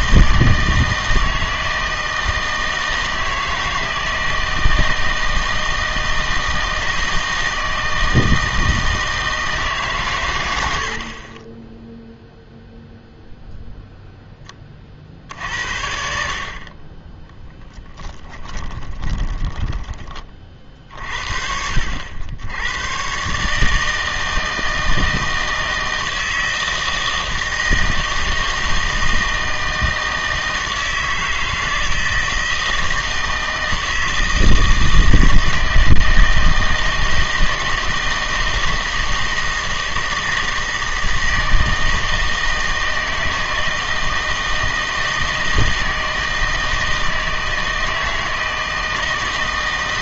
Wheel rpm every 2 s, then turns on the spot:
160, 160, 160, 160, 160, 90, 0, 30, 30, 20, 50, 100, 160, 160, 160, 160, 160, 160, 160, 160, 160, 160, 160, 160, 160.
18-20